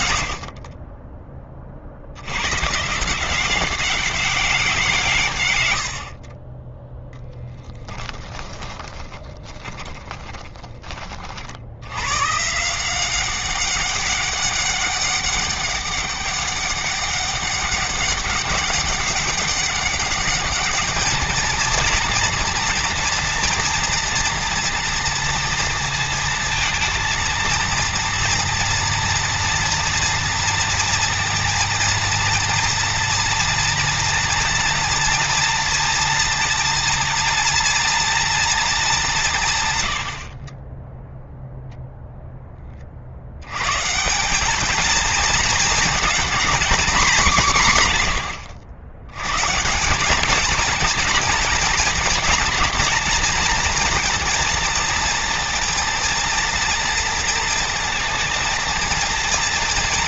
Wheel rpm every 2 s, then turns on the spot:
30, 160, 140, 10, 20, 30, 180, 200, 200, 200, 220, 230, 230, 230, 230, 230, 230, 230, 230, 200, 10, 60, 220, 200, 110, 230, 240, 230, 230, 230.
8-10 38-42